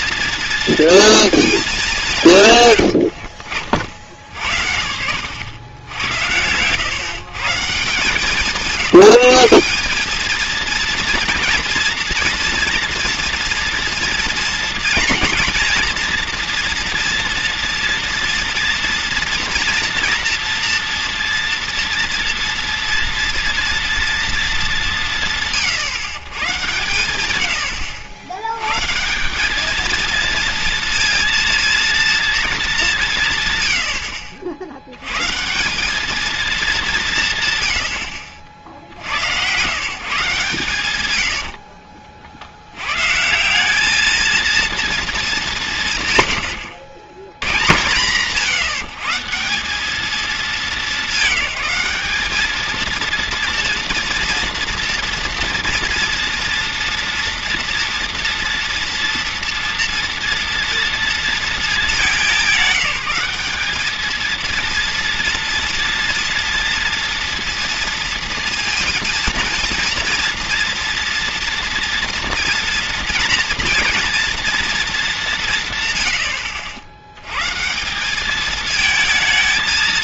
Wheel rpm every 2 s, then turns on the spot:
230, 120, 60, 120, 180, 230, 230, 230, 240, 230, 240, 240, 190, 130, 110, 230, 210, 70, 200, 60, 130, 90, 230, 80, 150, 210, 220, 230, 230, 230, 230, 200, 230, 230, 230, 230, 240, 230, 90, 220.
none